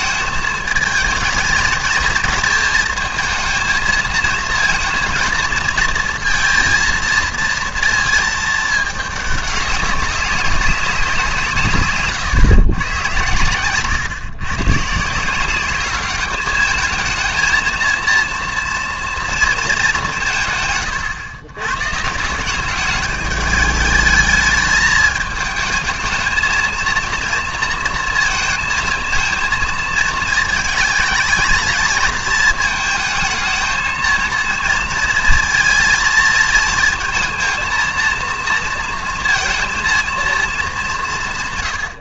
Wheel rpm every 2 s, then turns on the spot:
220, 230, 230, 230, 220, 200, 130, 130, 220, 230, 140, 200, 210, 220, 230, 220, 220, 230, 230, 230, 200.
none